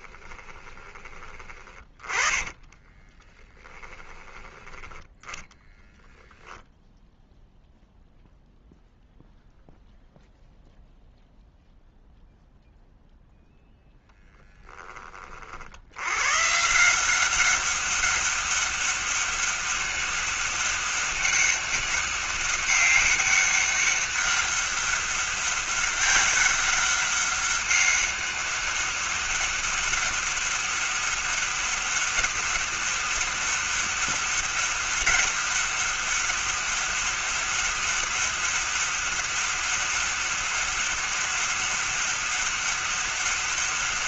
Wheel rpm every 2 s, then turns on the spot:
20, 10, 10, 0, 0, 0, 0, 10, 150, 200, 200, 190, 200, 200, 200, 200, 200, 200, 200, 200, 200, 200.
0-4